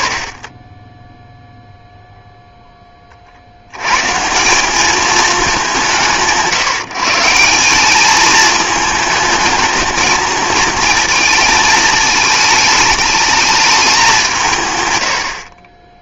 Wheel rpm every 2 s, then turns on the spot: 50, 10, 180, 150, 220, 230, 210, 120.
none